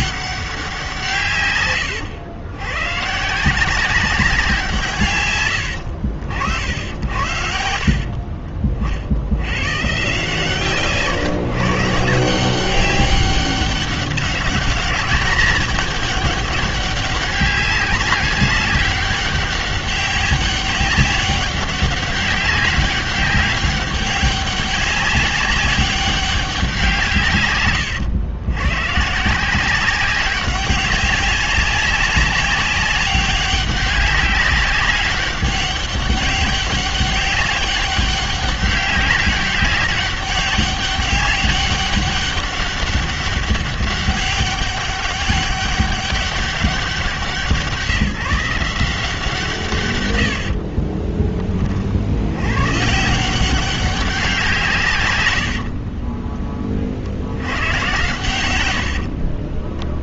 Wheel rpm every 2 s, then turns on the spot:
170, 130, 150, 80, 60, 150, 190, 210, 200, 200, 200, 200, 200, 180, 120, 190, 190, 200, 200, 200, 200, 200, 200, 190, 170, 30, 160, 120, 50, 70.
6-8 50-52 58-60